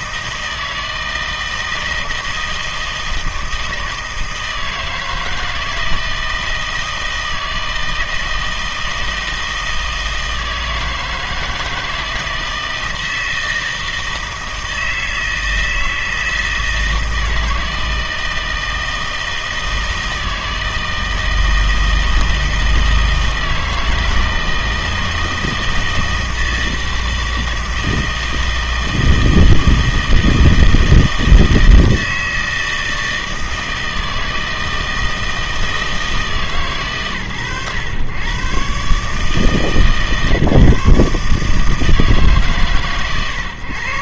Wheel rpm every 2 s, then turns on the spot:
160, 160, 160, 160, 160, 160, 160, 160, 160, 160, 160, 160, 160, 160, 160, 160, 160, 160, 130, 130, 150, 150.
none